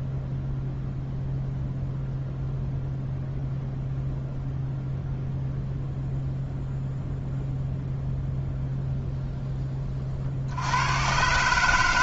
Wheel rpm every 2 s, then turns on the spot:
0, 0, 0, 0, 0, 100.
none